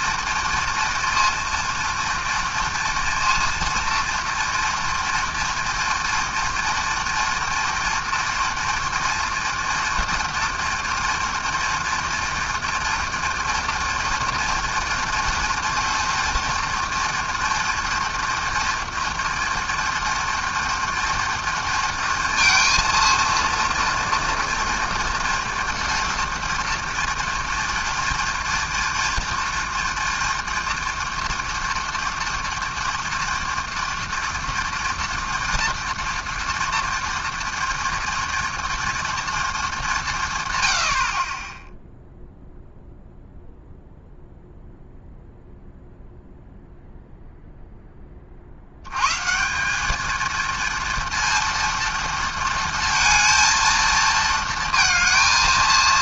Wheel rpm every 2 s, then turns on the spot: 230, 230, 230, 230, 240, 230, 230, 230, 230, 230, 230, 230, 230, 230, 230, 230, 230, 230, 230, 230, 40, 0, 0, 0, 140, 230, 220, 220.
none